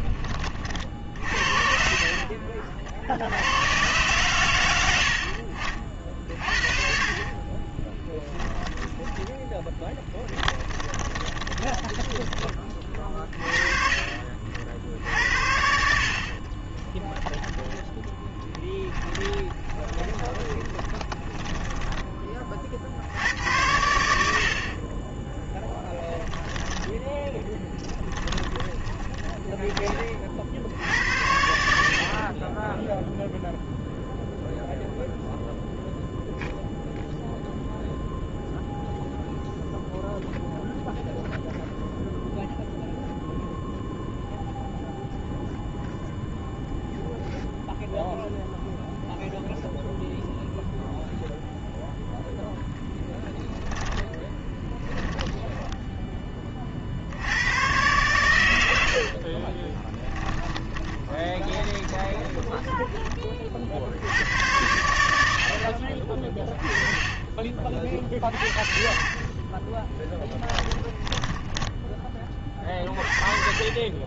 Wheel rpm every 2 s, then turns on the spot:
50, 110, 60, 30, 0, 20, 30, 80, 20, 20, 10, 80, 20, 10, 20, 80, 0, 0, 0, 0, 0, 0, 0, 0, 0, 0, 10, 20, 50, 70, 30, 10, 100, 20, 50, 10, 20.
0-2 6-8 10-12 18-22 26-30 52-56 60-62 68-72